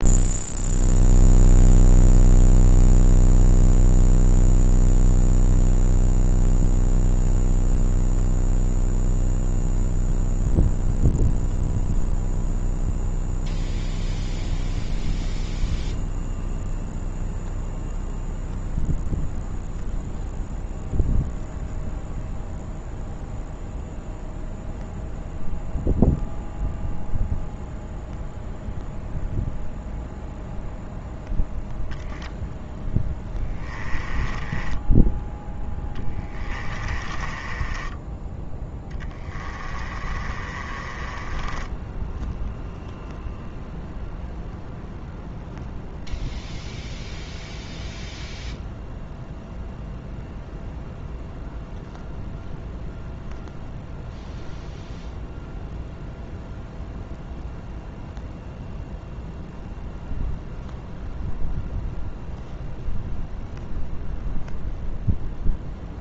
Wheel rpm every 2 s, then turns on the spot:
0, 0, 0, 0, 0, 0, 0, 0, 0, 0, 0, 0, 0, 0, 0, 0, 10, 10, 20, 20, 30, 0, 0, 0, 0, 0, 0, 0, 0, 0, 0, 0, 0.
34-42